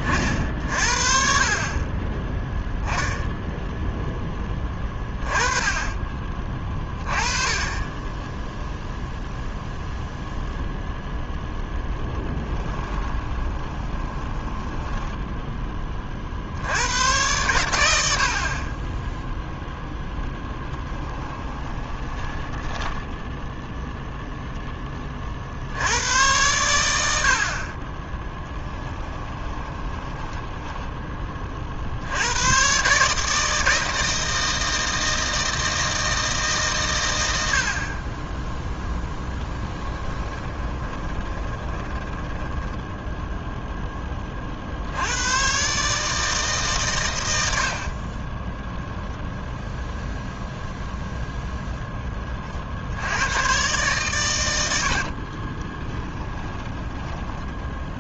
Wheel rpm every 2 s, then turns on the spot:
50, 0, 20, 20, 0, 0, 20, 10, 90, 20, 10, 20, 10, 90, 20, 10, 130, 160, 130, 10, 20, 10, 70, 130, 0, 0, 70, 80, 20.
12-16 20-24 28-32 40-42